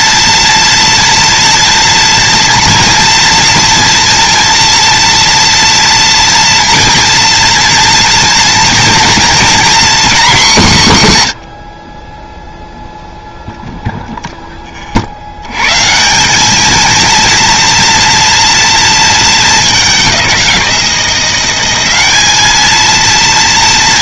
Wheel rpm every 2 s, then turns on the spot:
230, 230, 230, 230, 230, 160, 0, 50, 230, 230, 170, 230.
none